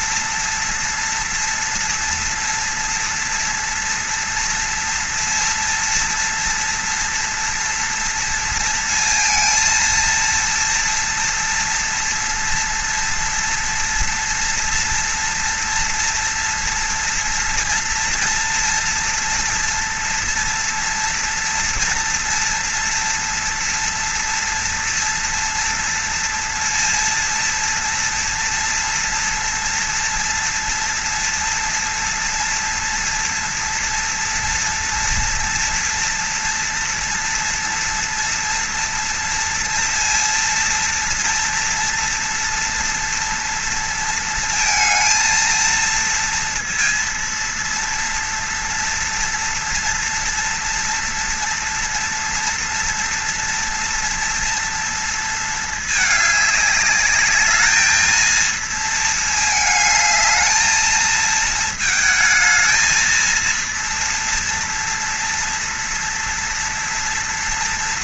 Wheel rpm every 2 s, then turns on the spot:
240, 240, 230, 230, 230, 230, 240, 230, 240, 230, 230, 230, 230, 230, 240, 230, 230, 230, 240, 230, 230, 230, 230, 230, 240, 230, 230, 230, 200, 220, 220, 220, 230, 230.
none